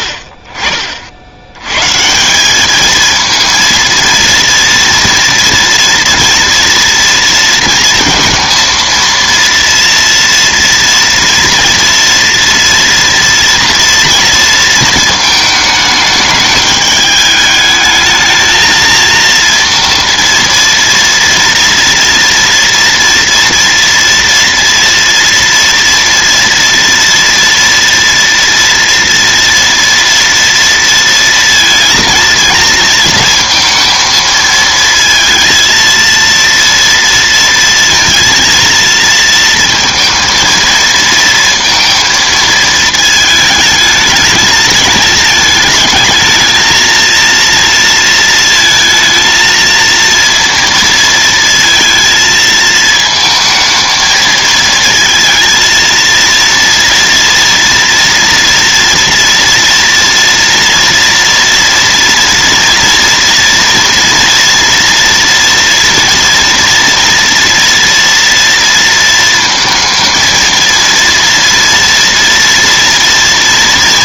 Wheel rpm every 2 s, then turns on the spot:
70, 200, 230, 230, 230, 230, 230, 220, 210, 220, 230, 230, 230, 230, 230, 230, 230, 230, 230, 230, 230, 220, 220, 220, 230, 230, 220, 220, 230, 240, 230, 230, 230, 230, 230, 230, 230.
none